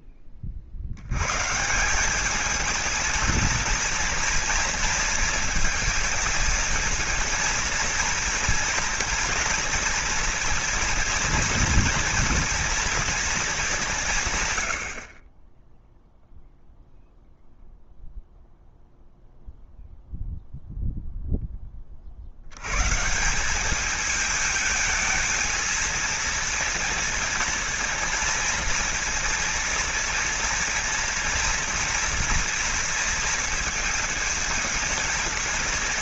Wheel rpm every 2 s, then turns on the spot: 80, 230, 230, 220, 240, 230, 230, 60, 0, 0, 0, 130, 220, 230, 230, 230, 230, 220.
none